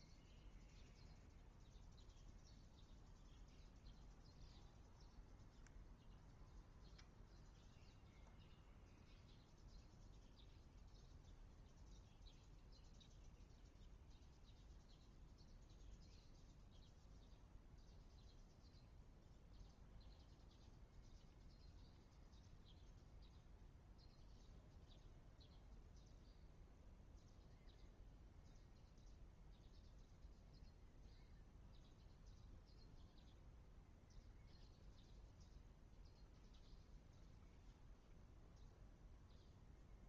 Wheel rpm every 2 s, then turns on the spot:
0, 0, 0, 0, 0, 0, 0, 0, 0, 0, 0, 0, 0, 0, 0, 0, 0, 0, 0, 0.
none